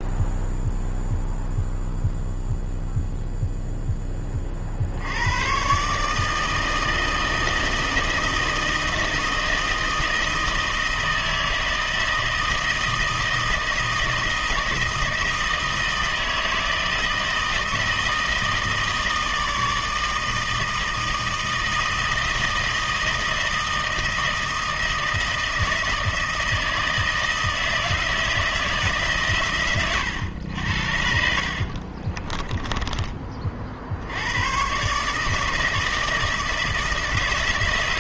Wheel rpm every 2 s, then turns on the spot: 0, 0, 30, 160, 160, 160, 160, 160, 160, 160, 160, 160, 160, 160, 160, 90, 20, 110, 160.
32-34